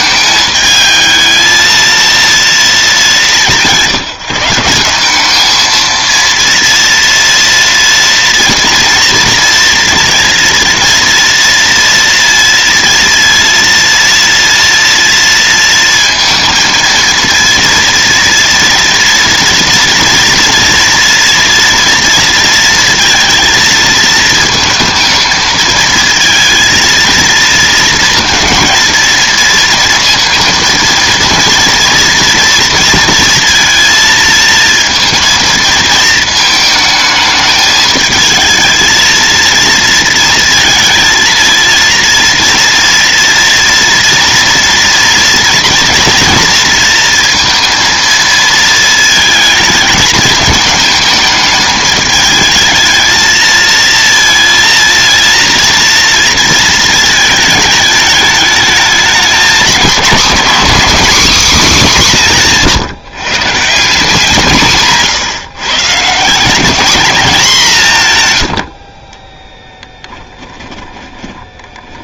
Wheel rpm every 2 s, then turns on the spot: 220, 180, 190, 230, 230, 230, 230, 230, 230, 230, 230, 230, 230, 230, 230, 230, 230, 230, 220, 230, 230, 230, 230, 230, 220, 210, 220, 230, 220, 210, 260, 150, 150, 210, 40, 30.
70-72